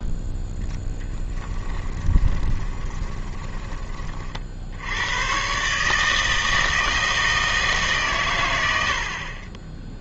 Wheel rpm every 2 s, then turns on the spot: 0, 20, 60, 160, 90.
2-4